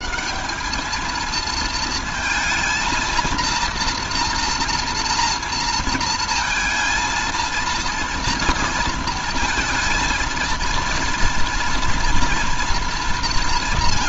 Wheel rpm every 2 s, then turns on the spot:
190, 220, 230, 230, 230, 230, 230.
none